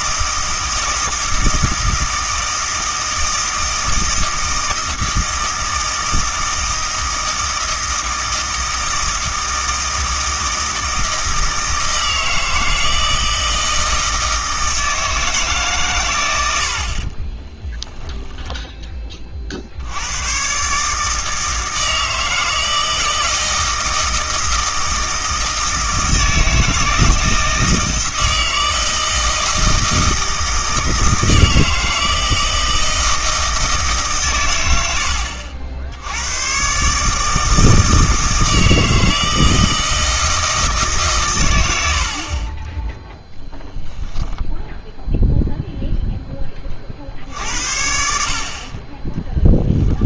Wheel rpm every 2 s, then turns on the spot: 160, 160, 160, 160, 160, 160, 160, 160, 70, 10, 140, 160, 160, 160, 160, 160, 160, 100, 130, 160, 150, 10, 0, 40, 40.
42-44